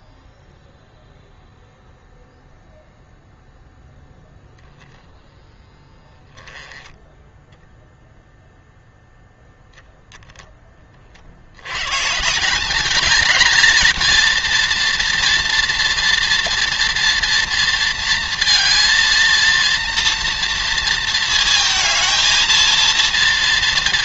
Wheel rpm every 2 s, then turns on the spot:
0, 0, 0, 10, 0, 10, 200, 230, 230, 230, 230, 230.
none